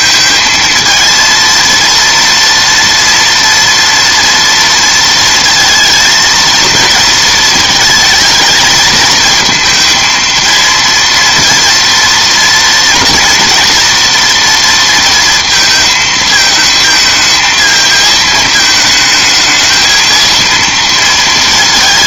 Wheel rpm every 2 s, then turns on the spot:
220, 230, 230, 230, 220, 230, 230, 230, 220, 220, 230.
none